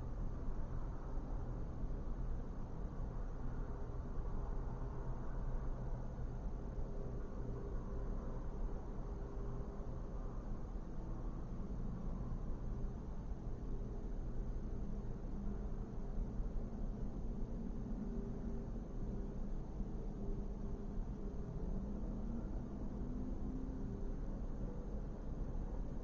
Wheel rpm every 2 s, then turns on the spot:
0, 0, 0, 0, 0, 0, 0, 0, 0, 0, 0, 0, 0.
none